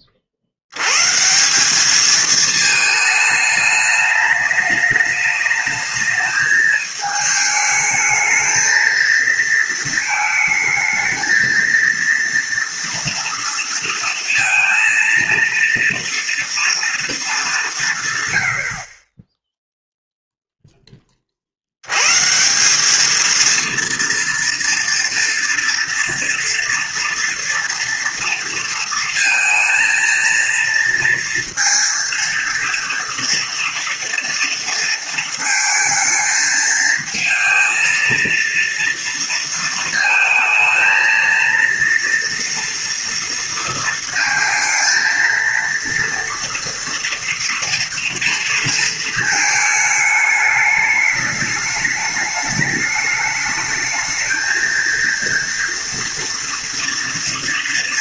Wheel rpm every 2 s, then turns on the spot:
40, 220, 220, 220, 220, 220, 230, 230, 230, 90, 0, 160, 230, 230, 230, 230, 230, 230, 220, 230, 220, 230, 230, 230, 230, 210, 210, 220, 230.
none